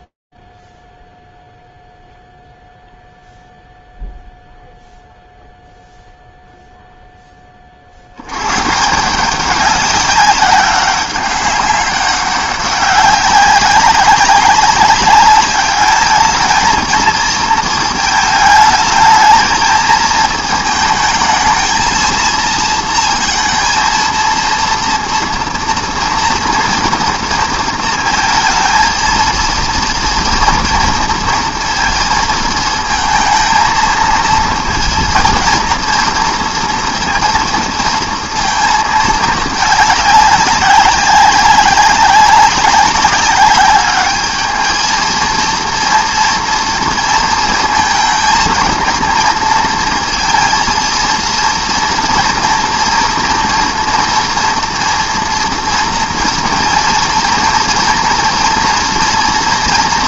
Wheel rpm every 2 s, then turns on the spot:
0, 0, 0, 0, 120, 200, 200, 190, 220, 220, 220, 230, 230, 230, 230, 230, 220, 230, 230, 230, 200, 190, 220, 230, 230, 230, 230, 230, 230, 240.
none